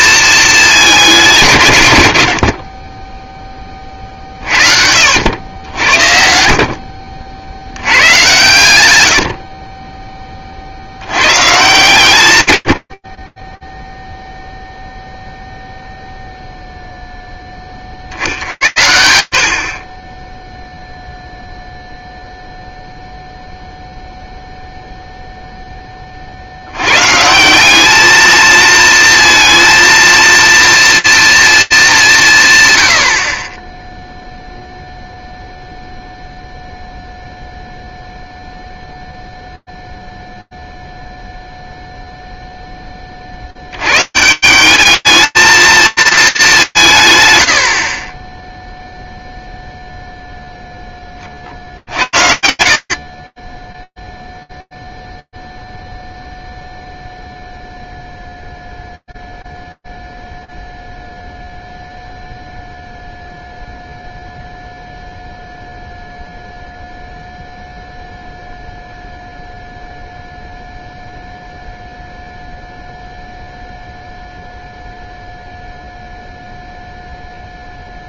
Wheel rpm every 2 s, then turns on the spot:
220, 90, 50, 60, 100, 70, 90, 0, 0, 80, 0, 0, 0, 140, 230, 230, 50, 0, 0, 0, 0, 130, 230, 50, 0, 80, 0, 0, 0, 0, 0, 0, 0, 0, 0, 0, 0, 0, 0.
none